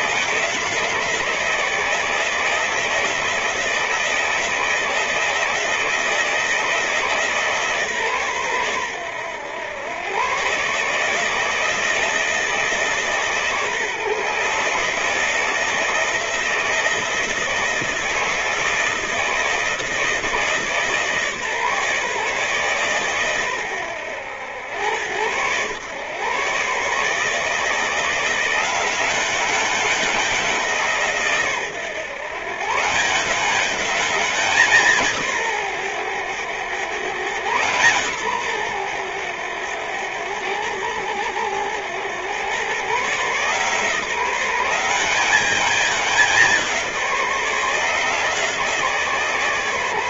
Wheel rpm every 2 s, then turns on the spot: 160, 160, 160, 160, 110, 160, 140, 160, 160, 160, 150, 120, 110, 160, 190, 130, 190, 140, 130, 90, 90, 140, 190, 160, 160.
none